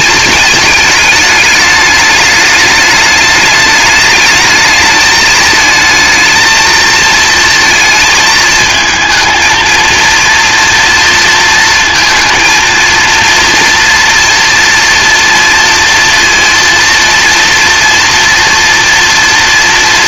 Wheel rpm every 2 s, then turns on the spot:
210, 210, 220, 220, 220, 230, 230, 230, 230, 230.
none